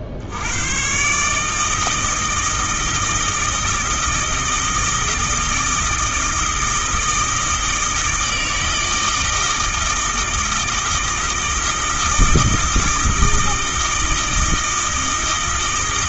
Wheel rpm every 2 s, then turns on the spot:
100, 160, 160, 160, 160, 160, 160, 160.
none